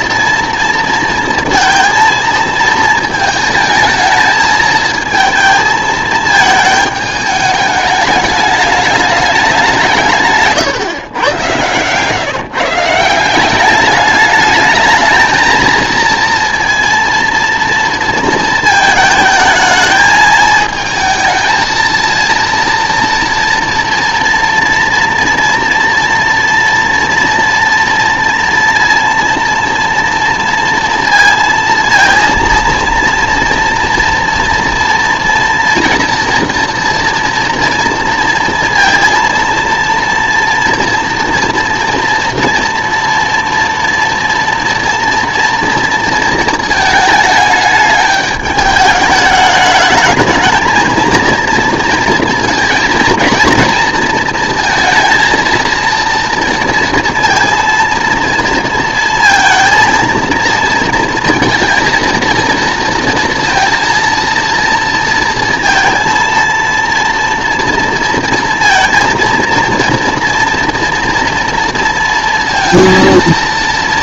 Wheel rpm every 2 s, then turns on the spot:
230, 220, 220, 220, 210, 140, 160, 220, 230, 220, 220, 230, 230, 230, 230, 230, 230, 230, 230, 230, 230, 230, 230, 220, 210, 220, 230, 230, 230, 230, 230, 230, 230, 230, 230, 240, 230.
none